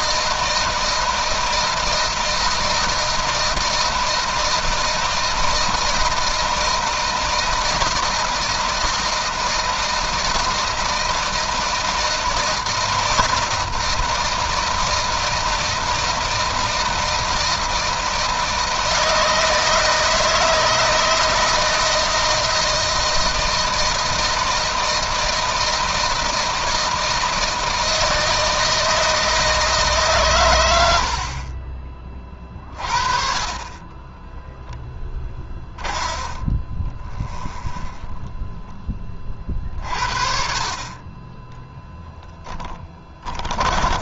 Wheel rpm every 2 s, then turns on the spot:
160, 160, 160, 160, 160, 160, 160, 160, 160, 160, 160, 160, 160, 160, 160, 90, 40, 10, 20, 20, 30, 20.
34-38 42-44